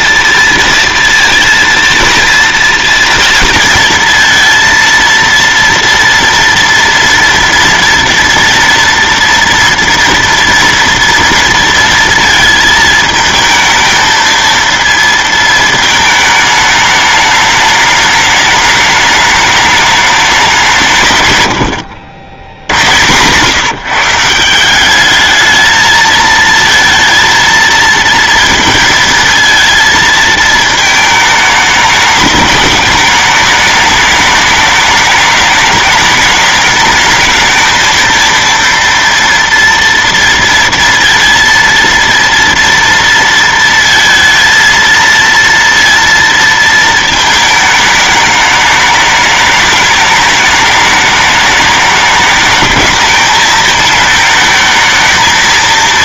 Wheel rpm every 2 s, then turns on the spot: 230, 230, 230, 230, 230, 230, 220, 220, 220, 210, 200, 90, 170, 230, 230, 220, 210, 210, 210, 230, 230, 230, 230, 230, 210, 210, 210, 220.
none